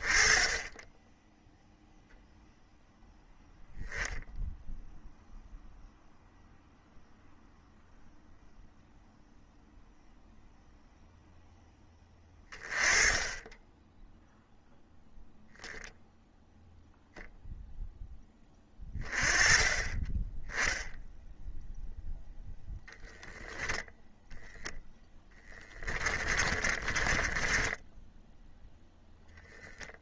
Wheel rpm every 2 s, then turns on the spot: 0, 0, 0, 0, 0, 10, 10, 0, 0, 20, 0, 0, 10, 20, 0.
26-28